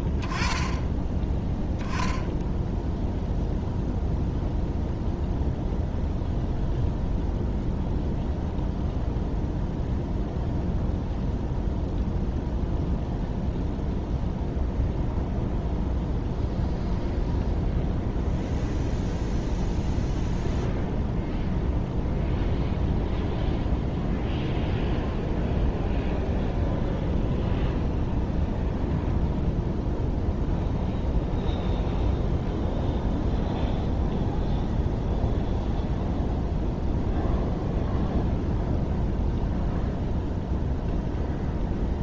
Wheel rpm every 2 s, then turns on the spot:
10, 0, 0, 0, 0, 0, 0, 0, 0, 0, 0, 0, 0, 0, 0, 0, 0, 0, 0, 0, 0.
none